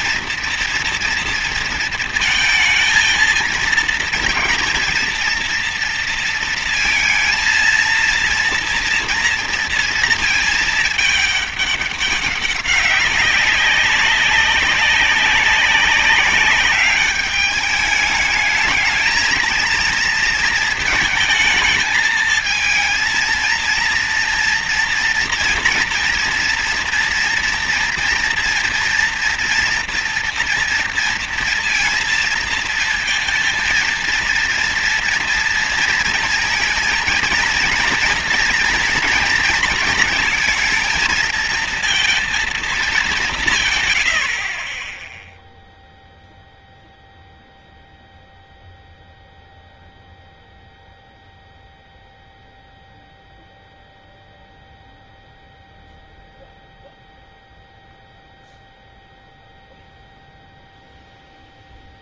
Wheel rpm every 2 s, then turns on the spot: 230, 220, 230, 230, 230, 220, 200, 190, 190, 210, 230, 220, 230, 230, 240, 240, 230, 230, 230, 230, 230, 230, 70, 0, 0, 0, 0, 0, 0, 0, 0.
none